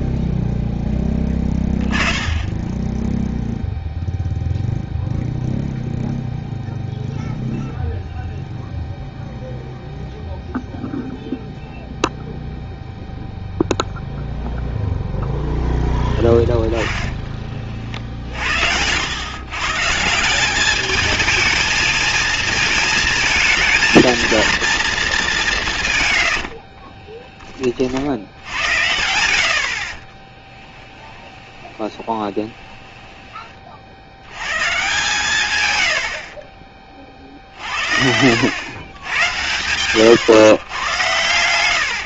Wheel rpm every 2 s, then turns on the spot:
0, 10, 0, 0, 0, 0, 0, 0, 10, 80, 210, 220, 220, 30, 80, 10, 20, 140, 40, 100, 110.
26-28 30-34 38-40